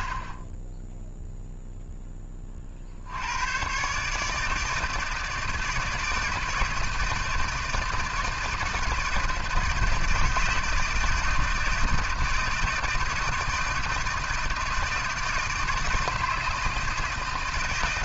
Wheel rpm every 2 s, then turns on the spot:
20, 50, 160, 160, 160, 160, 160, 160, 160.
none